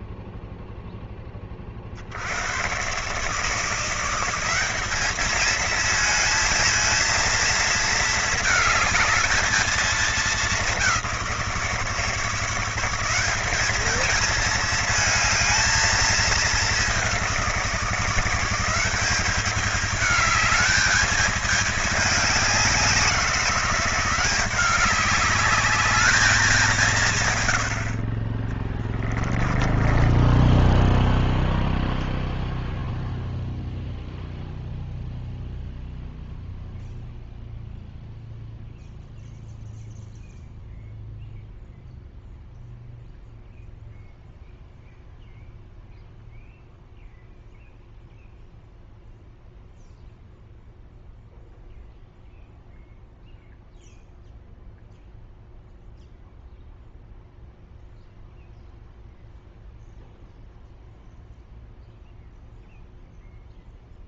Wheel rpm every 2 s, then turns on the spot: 0, 120, 200, 220, 220, 190, 170, 230, 200, 190, 210, 180, 190, 180, 20, 0, 0, 0, 0, 0, 0, 0, 0, 0, 0, 0, 0, 0, 0, 0, 0, 0.
28-30